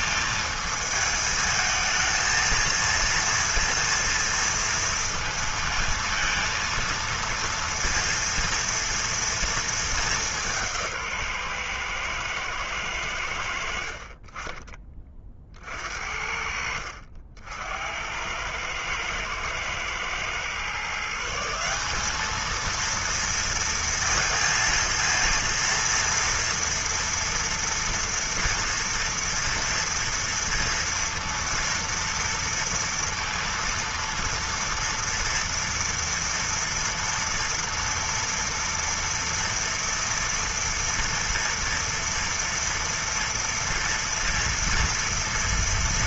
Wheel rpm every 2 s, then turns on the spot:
220, 230, 230, 230, 230, 160, 90, 40, 70, 110, 160, 230, 230, 230, 240, 230, 230, 230, 230, 230, 230, 230, 230.
none